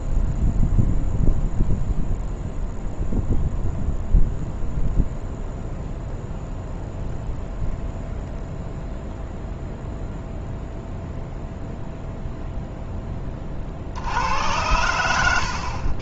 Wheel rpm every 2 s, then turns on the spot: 0, 0, 0, 0, 0, 0, 0, 100.
none